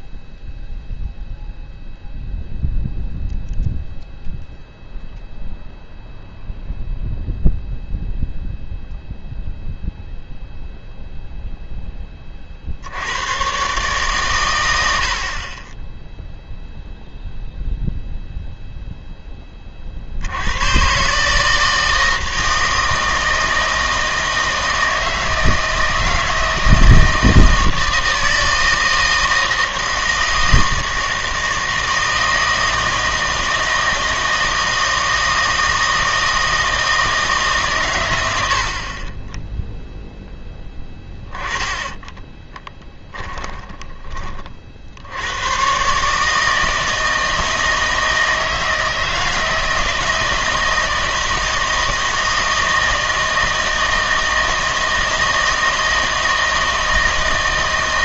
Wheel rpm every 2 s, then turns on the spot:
0, 0, 0, 0, 0, 0, 50, 100, 0, 0, 100, 160, 160, 160, 160, 160, 160, 160, 160, 60, 10, 20, 50, 160, 160, 160, 160, 160, 160.
42-44